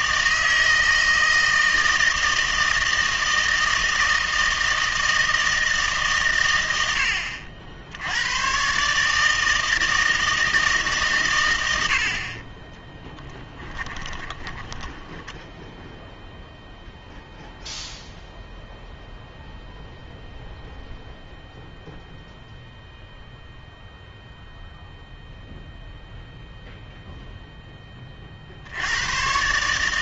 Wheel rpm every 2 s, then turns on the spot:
160, 160, 160, 60, 160, 100, 10, 10, 0, 0, 0, 0, 0, 0, 90.
12-16